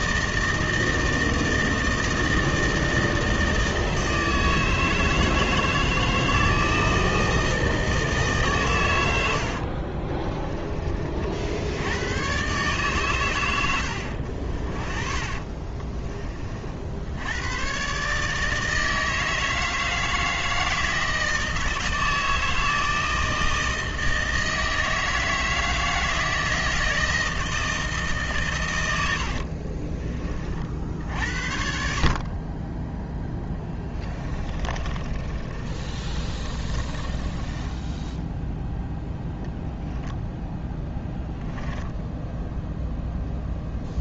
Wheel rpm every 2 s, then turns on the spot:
160, 160, 160, 170, 120, 30, 140, 40, 60, 160, 160, 160, 160, 160, 110, 50, 20, 20, 30, 10, 10, 0.
14-16 34-38 40-42